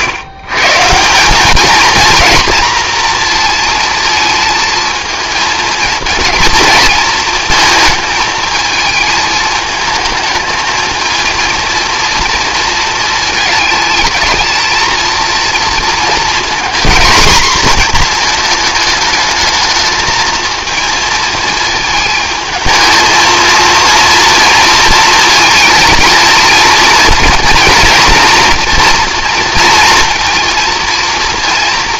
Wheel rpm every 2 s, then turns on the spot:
140, 240, 230, 230, 220, 220, 230, 220, 240, 220, 230, 220, 230, 230, 240, 230.
none